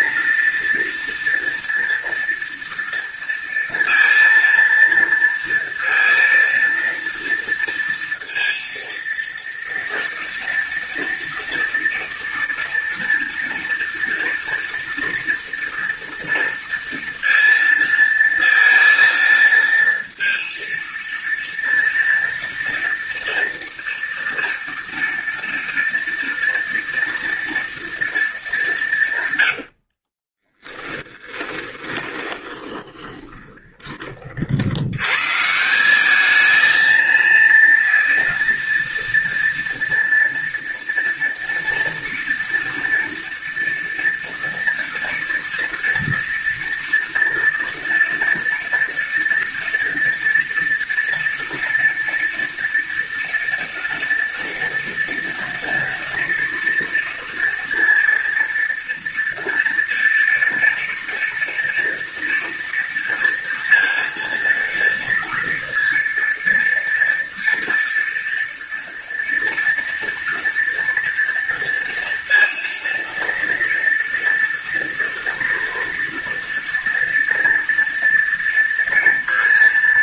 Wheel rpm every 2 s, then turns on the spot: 230, 230, 230, 230, 230, 230, 230, 230, 230, 230, 230, 230, 230, 230, 130, 10, 20, 140, 230, 230, 230, 230, 230, 230, 230, 230, 230, 230, 230, 230, 230, 230, 230, 230, 230, 230, 230, 230, 230, 230.
28-34